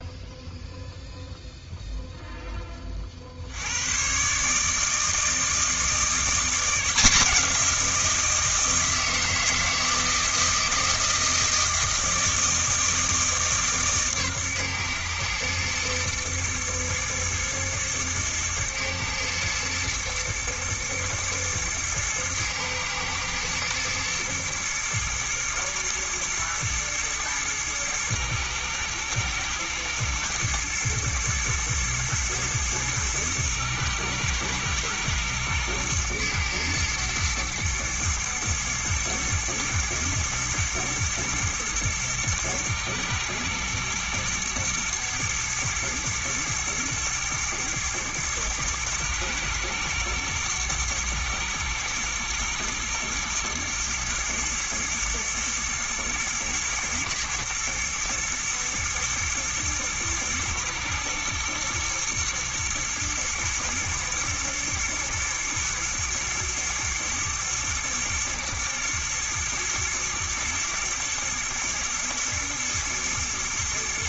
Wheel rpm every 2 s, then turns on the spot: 0, 30, 160, 170, 160, 160, 160, 120, 120, 110, 110, 120, 120, 110, 110, 110, 110, 110, 110, 110, 110, 110, 110, 120, 120, 110, 110, 110, 110, 110, 120, 110, 120, 120, 120, 110, 110.
none